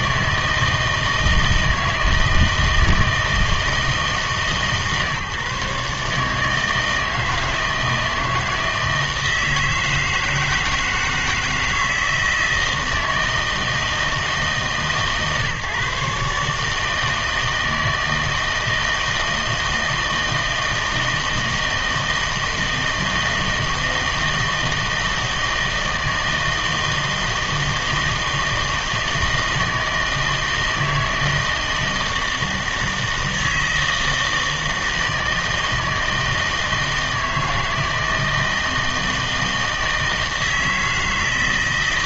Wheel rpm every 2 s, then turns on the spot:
160, 160, 150, 160, 160, 160, 160, 150, 150, 160, 160, 160, 160, 160, 160, 160, 160, 160, 160, 160, 160.
none